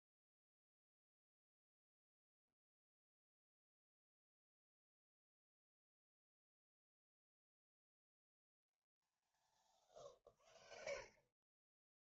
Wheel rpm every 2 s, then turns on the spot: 0, 0, 0, 0, 0, 0.
none